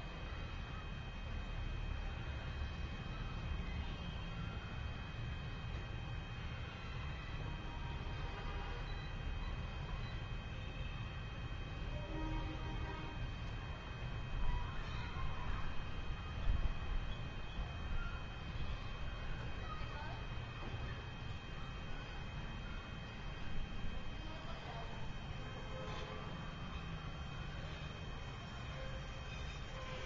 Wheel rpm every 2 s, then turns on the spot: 0, 0, 0, 0, 0, 0, 0, 0, 0, 0, 0, 0, 0, 0, 0.
none